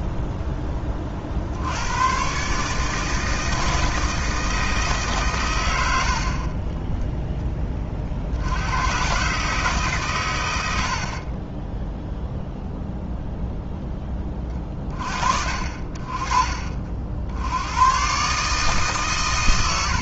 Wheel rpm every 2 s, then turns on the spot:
20, 150, 150, 20, 120, 60, 0, 30, 50, 150.
6-8